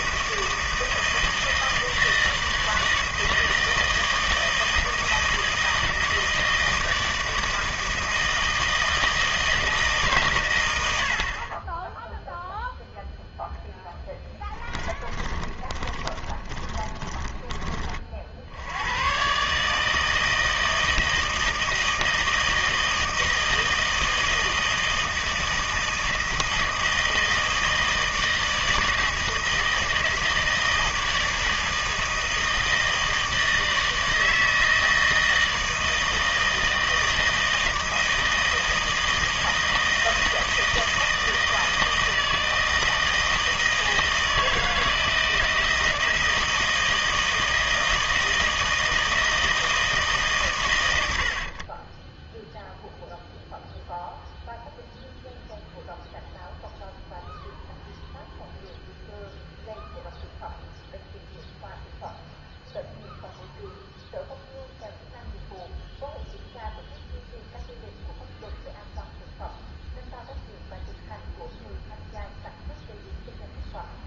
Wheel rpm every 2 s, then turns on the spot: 160, 160, 160, 160, 160, 100, 0, 10, 20, 80, 160, 160, 160, 160, 160, 160, 160, 160, 160, 160, 160, 160, 160, 160, 160, 110, 0, 0, 0, 0, 0, 0, 0, 0, 0, 0, 0.
14-18